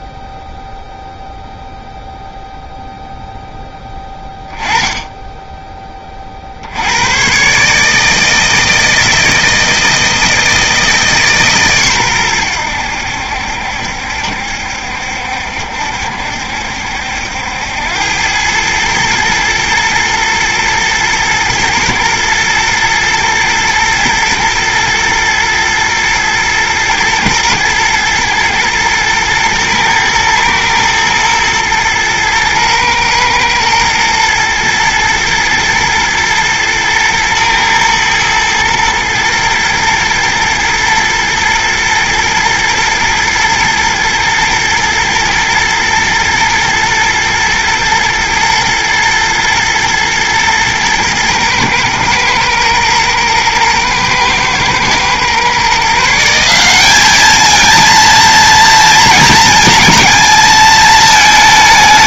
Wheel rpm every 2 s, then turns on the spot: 0, 0, 10, 60, 160, 160, 100, 70, 70, 100, 110, 110, 110, 120, 110, 110, 120, 110, 110, 110, 120, 120, 110, 110, 110, 110, 120, 110, 190, 230, 220.
none